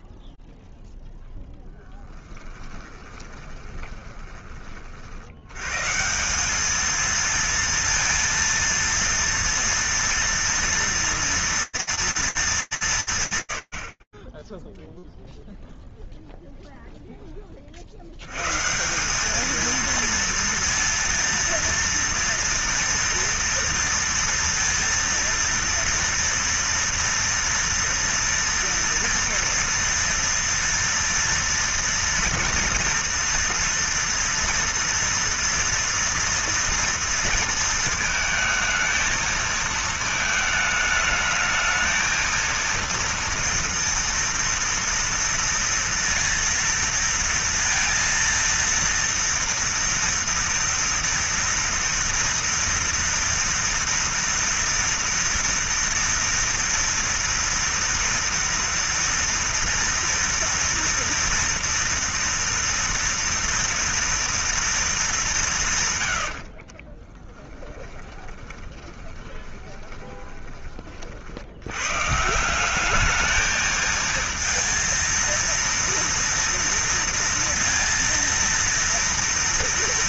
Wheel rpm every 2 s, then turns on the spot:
0, 20, 50, 220, 230, 230, 210, 0, 0, 170, 230, 240, 230, 230, 240, 230, 230, 230, 230, 220, 220, 230, 230, 230, 230, 230, 230, 230, 230, 230, 230, 230, 110, 20, 20, 140, 220, 230, 230, 230.
2-4 66-70